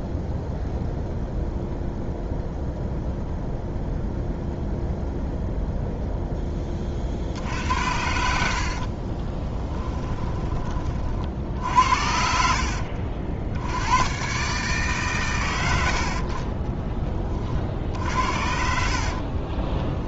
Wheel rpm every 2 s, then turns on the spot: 0, 0, 0, 40, 50, 40, 60, 140, 20, 60.
8-10 18-20